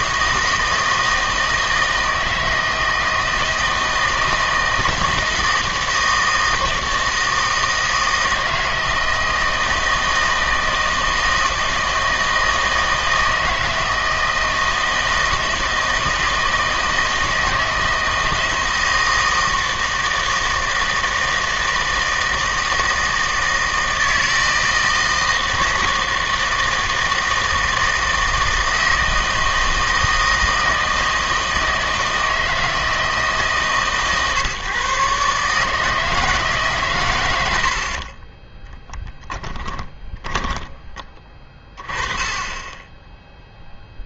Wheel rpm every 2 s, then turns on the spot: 160, 160, 160, 160, 160, 160, 160, 160, 160, 160, 160, 160, 160, 160, 160, 160, 160, 140, 140, 10, 20, 20.
38-42